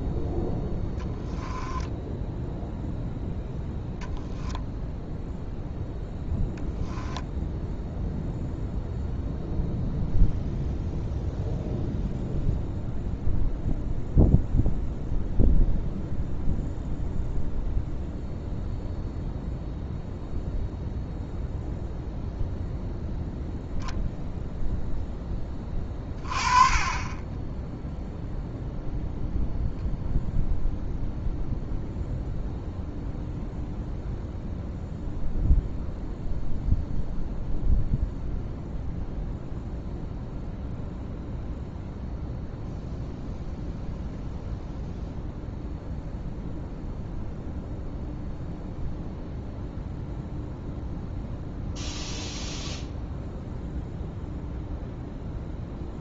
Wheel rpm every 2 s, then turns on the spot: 0, 0, 0, 10, 0, 0, 0, 0, 0, 0, 0, 0, 0, 20, 0, 0, 0, 0, 0, 0, 0, 0, 0, 0, 0, 0, 0, 0.
none